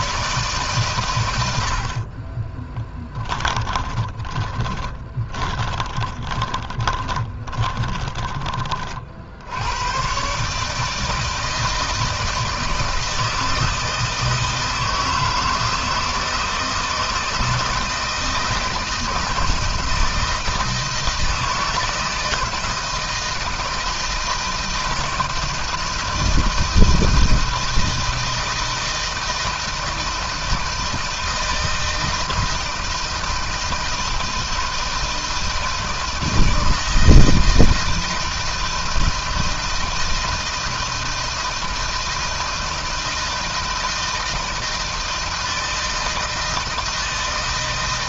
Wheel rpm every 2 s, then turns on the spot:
130, 10, 20, 20, 40, 150, 160, 160, 160, 160, 160, 160, 160, 160, 160, 160, 160, 160, 160, 160, 160, 160, 160, 160.
2-8